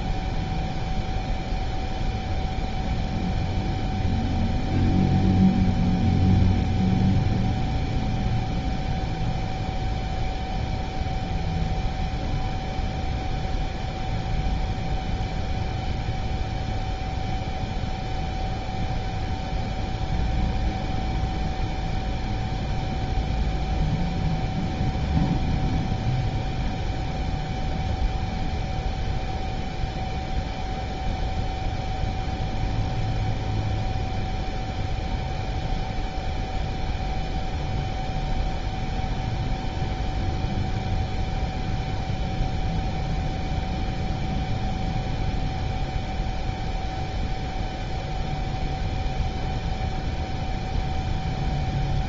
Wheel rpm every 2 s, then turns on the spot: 0, 0, 0, 0, 0, 0, 0, 0, 0, 0, 0, 0, 0, 0, 0, 0, 0, 0, 0, 0, 0, 0, 0, 0, 0, 0.
none